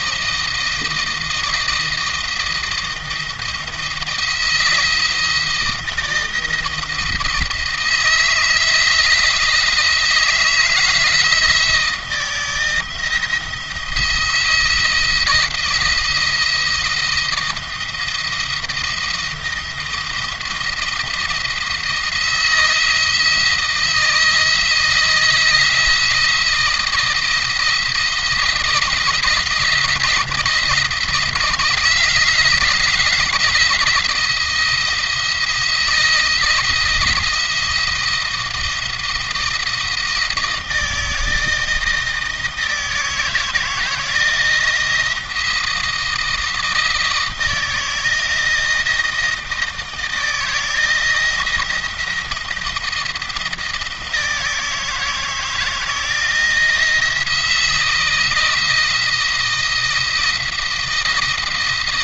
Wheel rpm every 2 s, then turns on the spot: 160, 170, 170, 160, 170, 160, 160, 170, 170, 170, 170, 170, 160, 170, 170, 160, 160, 170, 170, 170, 160, 160, 170, 160, 160, 160, 170, 160, 170, 160, 170.
none